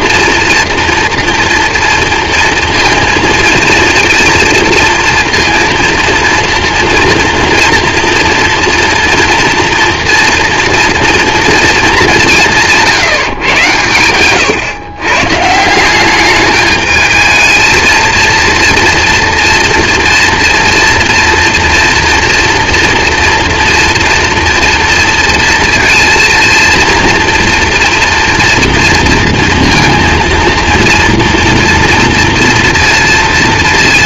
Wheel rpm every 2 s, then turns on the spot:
240, 230, 230, 230, 230, 240, 170, 120, 210, 240, 230, 240, 230, 230, 230, 230, 230.
none